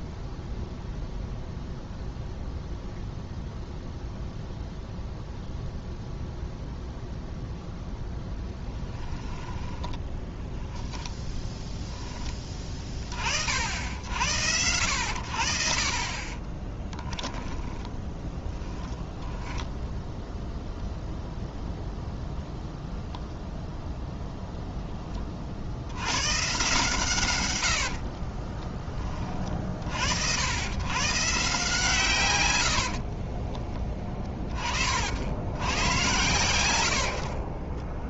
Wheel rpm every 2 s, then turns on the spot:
0, 0, 0, 0, 10, 10, 30, 80, 20, 10, 0, 0, 0, 130, 20, 110, 80, 40, 80.
8-10 16-18 28-30 32-34